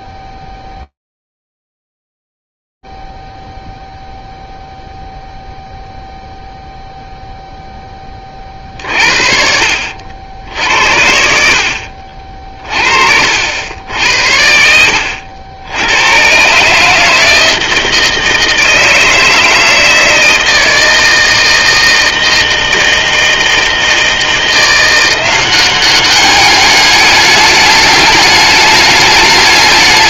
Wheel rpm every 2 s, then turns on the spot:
0, 0, 0, 0, 40, 70, 50, 70, 150, 160, 160, 160, 170, 210, 210.
14-16